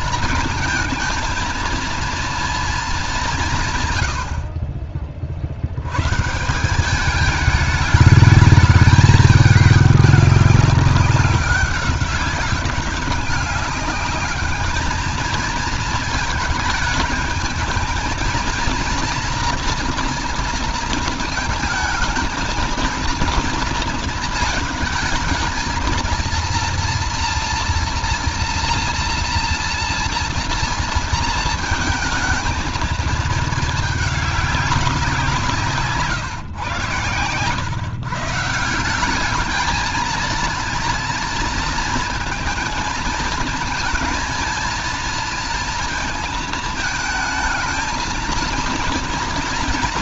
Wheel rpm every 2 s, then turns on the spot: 220, 230, 60, 160, 210, 200, 190, 210, 220, 230, 230, 230, 220, 230, 230, 230, 220, 200, 120, 170, 230, 230, 230, 220, 230.
none